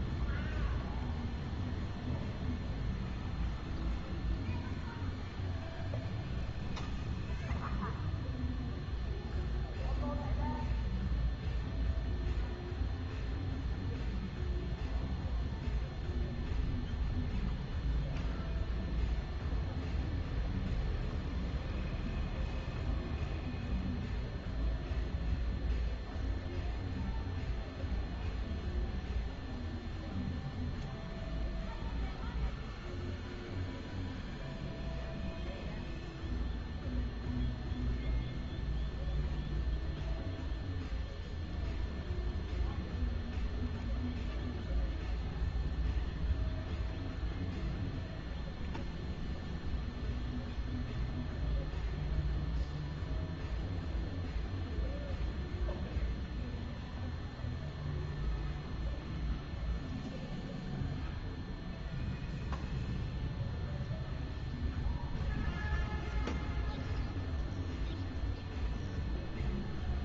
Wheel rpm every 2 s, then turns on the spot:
0, 0, 0, 0, 0, 0, 0, 0, 0, 0, 0, 0, 0, 0, 0, 0, 0, 0, 0, 0, 0, 0, 0, 0, 0, 0, 0, 0, 0, 0, 0, 0, 0, 0, 0.
none